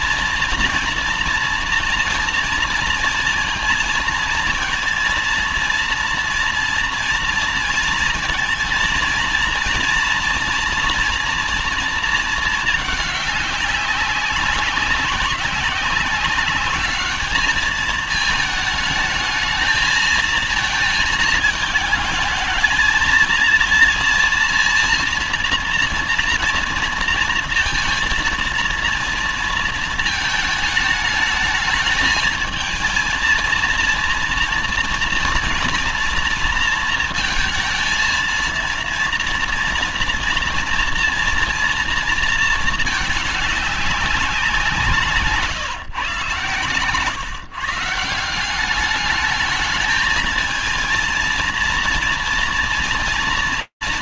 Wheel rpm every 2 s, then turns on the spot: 230, 230, 220, 230, 230, 230, 220, 200, 200, 220, 230, 220, 230, 230, 230, 220, 220, 230, 230, 230, 240, 230, 190, 140, 190, 230, 230.
none